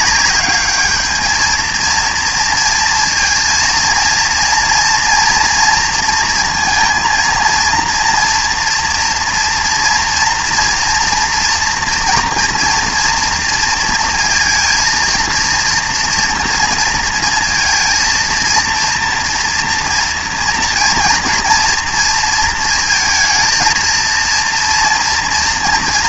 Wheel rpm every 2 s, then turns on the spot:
210, 230, 230, 230, 230, 240, 230, 230, 230, 230, 230, 230, 230.
none